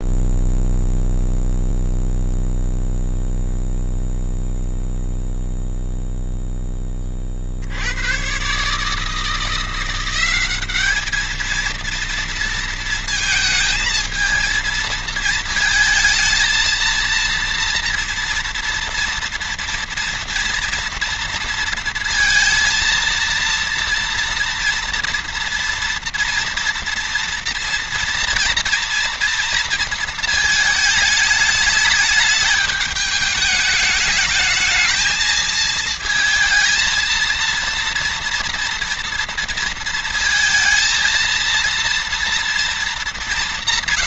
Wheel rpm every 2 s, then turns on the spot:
0, 0, 0, 30, 150, 210, 220, 220, 230, 230, 230, 230, 230, 230, 230, 220, 210, 220, 230, 230, 220, 210.
none